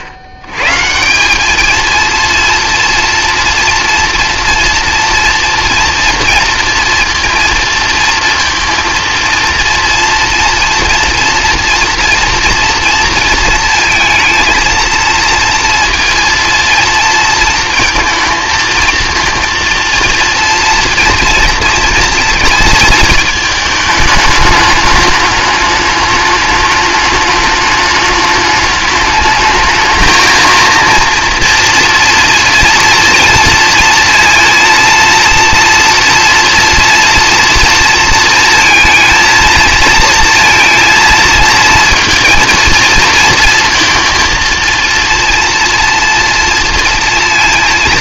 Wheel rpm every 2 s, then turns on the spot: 130, 230, 230, 230, 230, 240, 230, 230, 230, 220, 230, 220, 210, 210, 210, 230, 230, 230, 230, 230, 230, 220, 230, 230.
none